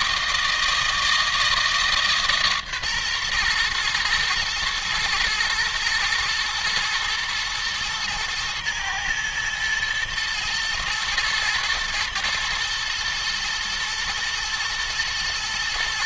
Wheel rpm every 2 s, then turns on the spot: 160, 140, 120, 120, 110, 110, 120, 120.
none